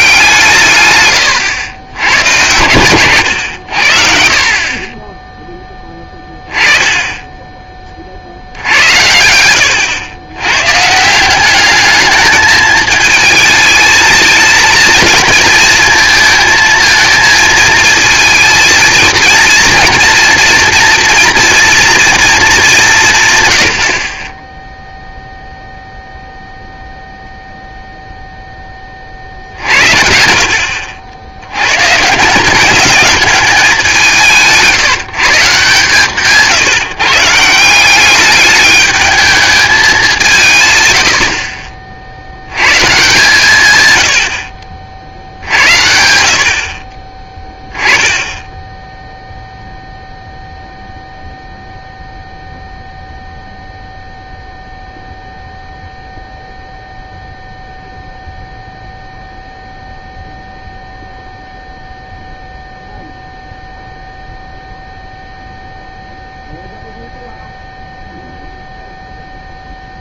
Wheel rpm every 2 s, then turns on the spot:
150, 120, 50, 10, 80, 120, 220, 220, 220, 230, 230, 210, 10, 0, 10, 70, 190, 170, 170, 210, 170, 110, 70, 50, 10, 0, 0, 0, 0, 0, 0, 0, 0, 0, 0.
none